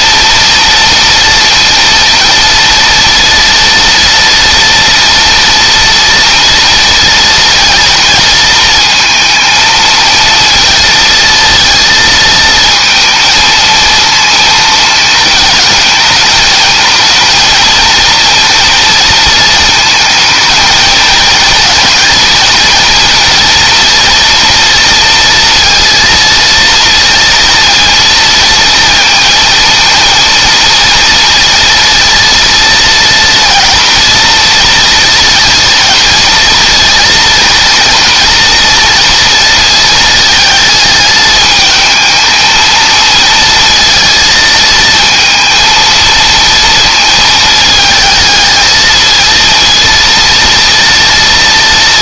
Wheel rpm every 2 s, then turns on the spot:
230, 230, 230, 230, 230, 230, 220, 220, 220, 230, 220, 230, 240, 230, 230, 230, 230, 230, 230, 230, 220, 220, 230, 230, 220, 230.
none